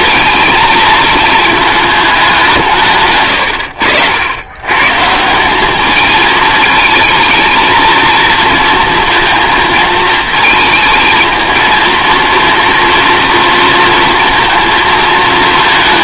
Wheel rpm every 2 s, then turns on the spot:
220, 160, 130, 220, 230, 220, 230, 230.
none